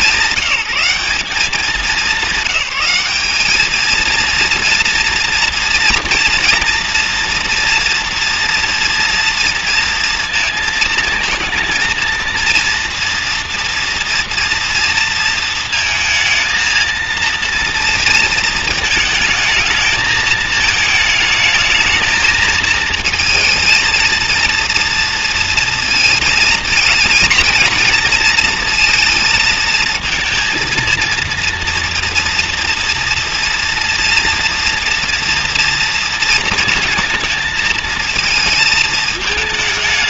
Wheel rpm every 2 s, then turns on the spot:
190, 190, 230, 230, 230, 230, 230, 230, 230, 230, 220, 230, 230, 220, 230, 230, 230, 240, 230, 220.
none